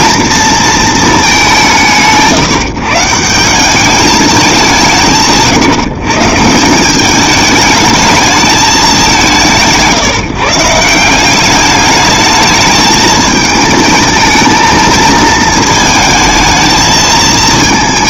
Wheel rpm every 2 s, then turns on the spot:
230, 160, 170, 170, 210, 150, 220, 220, 220.
none